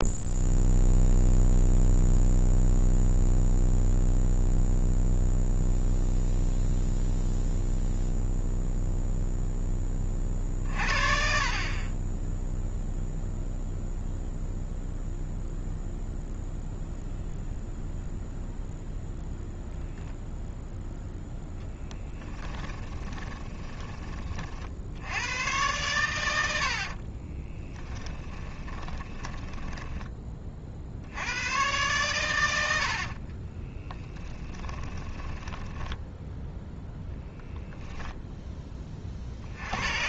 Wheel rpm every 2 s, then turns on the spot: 0, 0, 0, 0, 0, 40, 0, 0, 0, 0, 0, 10, 60, 60, 10, 50, 80, 10, 0, 20.
22-24 26-30 32-36